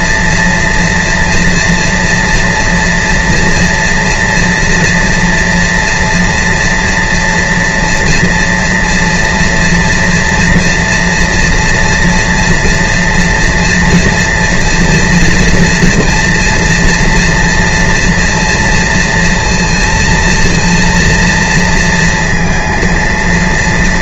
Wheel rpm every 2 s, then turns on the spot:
230, 240, 230, 230, 230, 230, 230, 230, 230, 230, 230, 230.
none